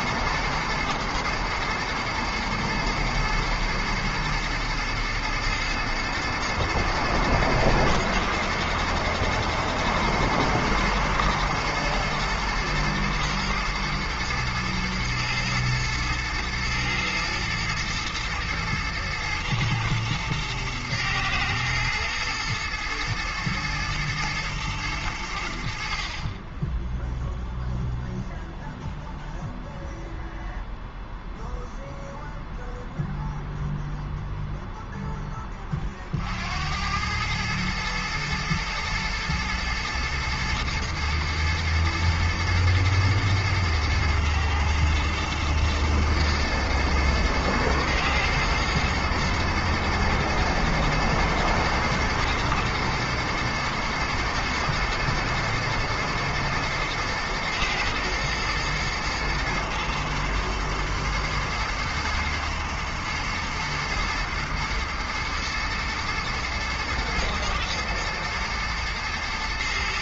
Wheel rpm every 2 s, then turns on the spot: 110, 110, 110, 110, 110, 110, 120, 110, 110, 120, 110, 110, 110, 10, 0, 0, 0, 0, 90, 110, 110, 110, 110, 110, 110, 120, 120, 110, 120, 120, 110, 110, 120, 110, 120.
none